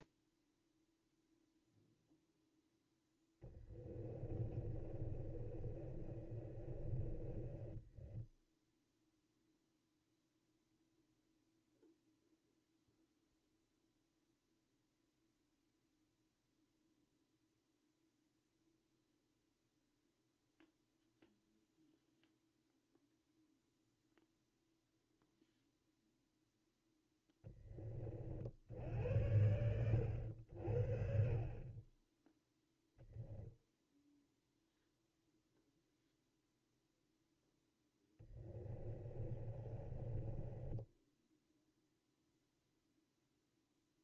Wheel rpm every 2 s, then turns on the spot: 0, 10, 30, 30, 0, 0, 0, 0, 0, 0, 0, 0, 0, 0, 70, 50, 0, 0, 0, 20, 10, 0.
2-8 38-42